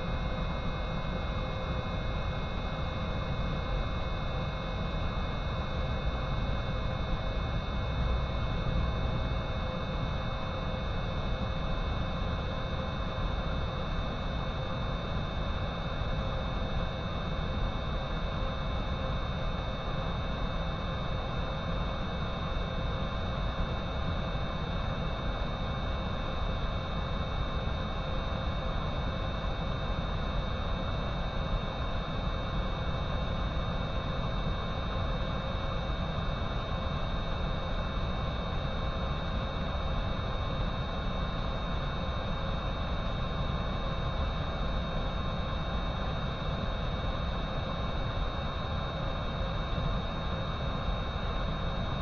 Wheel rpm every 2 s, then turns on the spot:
0, 0, 0, 0, 0, 0, 0, 0, 0, 0, 0, 0, 0, 0, 0, 0, 0, 0, 0, 0, 0, 0, 0, 0, 0, 0.
none